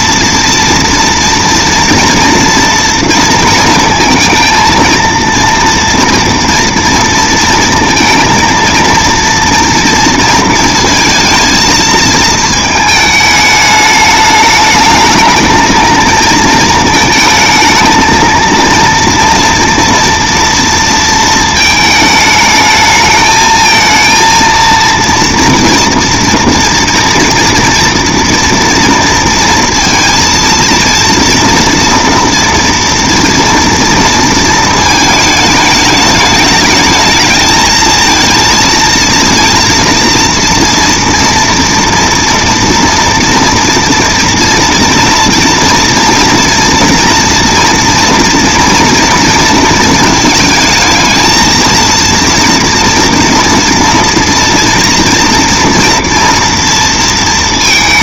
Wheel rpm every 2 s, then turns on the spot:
230, 230, 230, 230, 230, 230, 210, 220, 220, 230, 230, 220, 230, 230, 230, 240, 240, 220, 220, 230, 230, 230, 230, 230, 230, 230, 230, 230, 230.
none